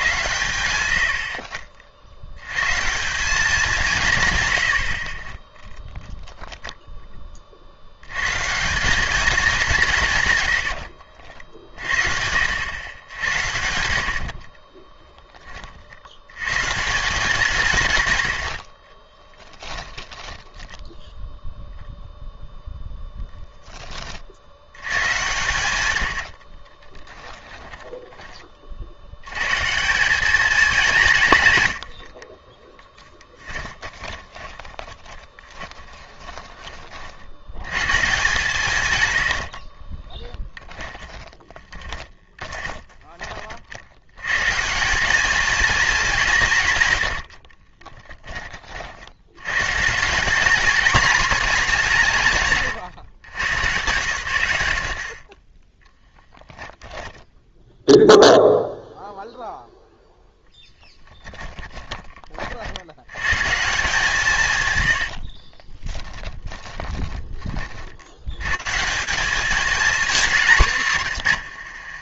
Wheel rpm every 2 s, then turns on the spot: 90, 140, 90, 10, 180, 90, 90, 20, 160, 50, 10, 0, 100, 30, 50, 200, 10, 20, 30, 130, 20, 20, 170, 130, 40, 220, 130, 70, 10, 0, 10, 80, 100, 20, 170, 160.
10-12 14-16 18-22 26-28 32-36 40-44 46-48 56-58 64-68